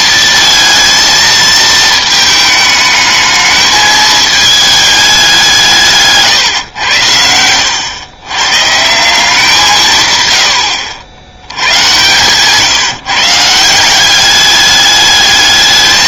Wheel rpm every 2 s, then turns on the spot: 220, 220, 210, 120, 140, 90, 140, 200.
10-12